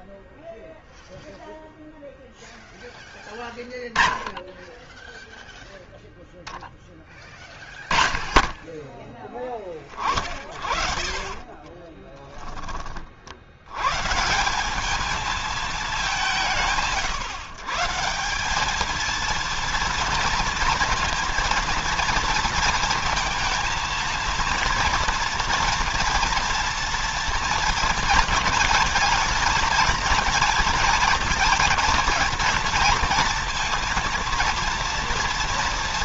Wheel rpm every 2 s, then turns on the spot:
0, 0, 10, 0, 10, 60, 20, 190, 170, 200, 230, 230, 230, 230, 220, 220, 230, 230.
10-12